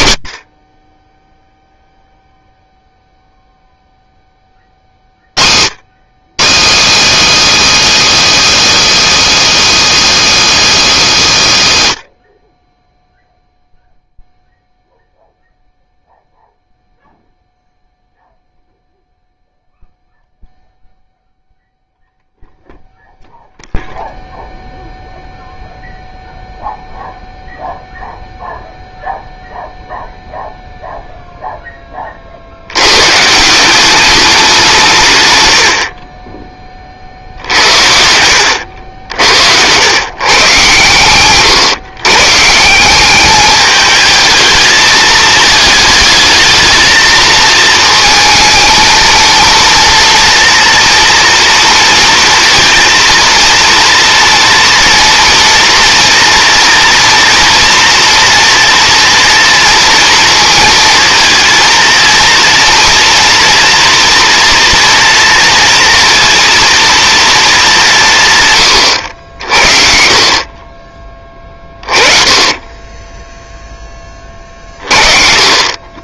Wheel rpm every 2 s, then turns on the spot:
30, 0, 50, 270, 340, 320, 20, 0, 0, 0, 0, 0, 0, 0, 0, 0, 100, 170, 40, 80, 120, 190, 210, 220, 220, 230, 230, 230, 230, 230, 230, 230, 230, 230, 110, 30, 20, 40.
none